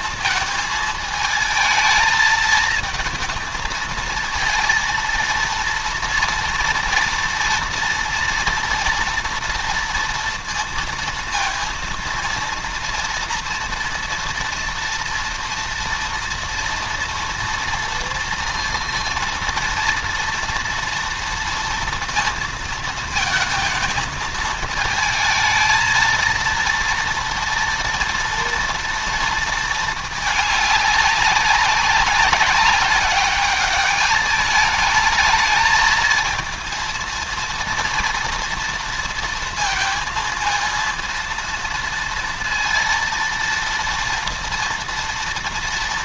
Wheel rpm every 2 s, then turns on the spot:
230, 220, 220, 230, 240, 230, 230, 240, 230, 230, 230, 230, 220, 230, 230, 210, 200, 210, 230, 230, 230, 230, 230.
none